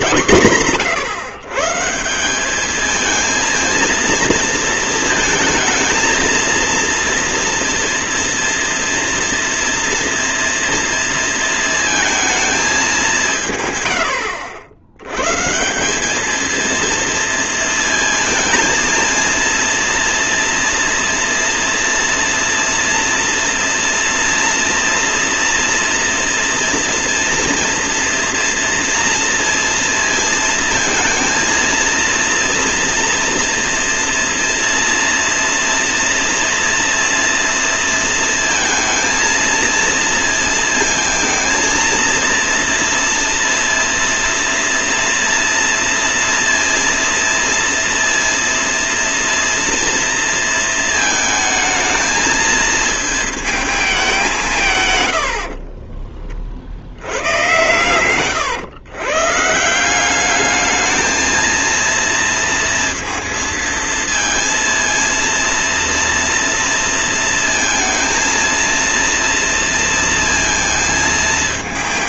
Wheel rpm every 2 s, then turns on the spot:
130, 220, 220, 230, 230, 230, 210, 90, 230, 230, 230, 230, 230, 230, 230, 230, 230, 230, 230, 230, 220, 230, 230, 230, 230, 220, 220, 130, 60, 120, 210, 230, 230, 230, 230, 230.
54-56